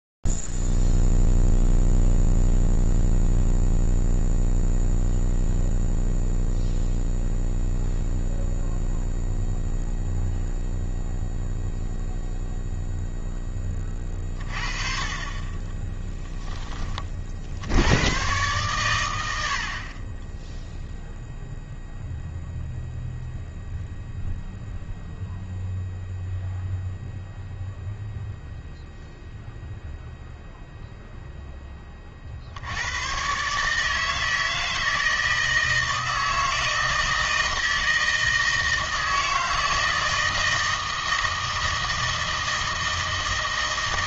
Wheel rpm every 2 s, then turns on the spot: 0, 0, 0, 0, 0, 0, 0, 30, 10, 110, 10, 0, 0, 0, 0, 0, 80, 160, 160, 160, 160, 160.
none